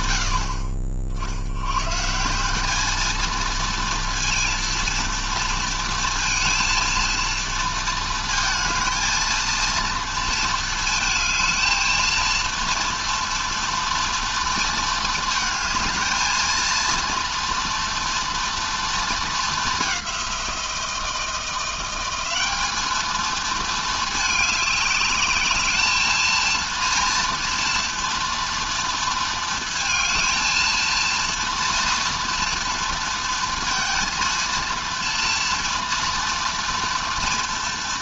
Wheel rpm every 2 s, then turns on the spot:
60, 230, 230, 230, 230, 220, 230, 220, 230, 220, 170, 220, 210, 230, 230, 230, 230, 230, 240.
none